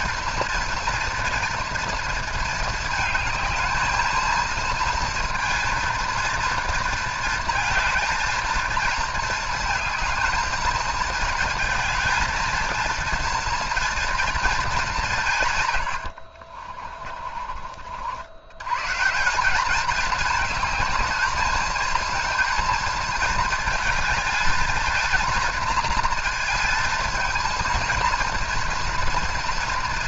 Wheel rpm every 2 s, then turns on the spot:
230, 220, 230, 230, 230, 220, 220, 220, 40, 100, 220, 230, 220, 230, 240.
16-18